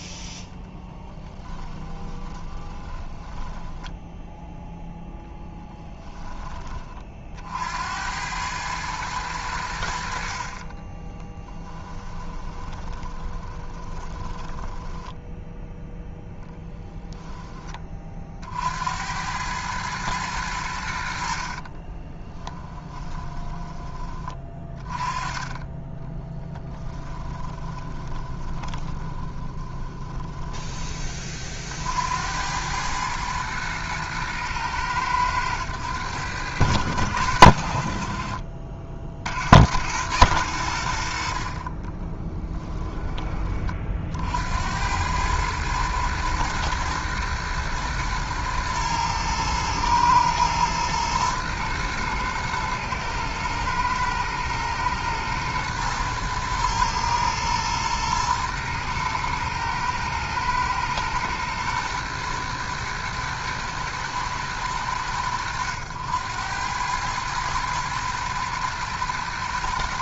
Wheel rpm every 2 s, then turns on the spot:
10, 30, 0, 20, 110, 40, 20, 10, 0, 70, 90, 10, 20, 10, 20, 20, 100, 110, 90, 50, 80, 10, 90, 120, 110, 110, 110, 110, 110, 110, 120, 120, 100, 100, 120.
0-4 10-16 20-24 26-30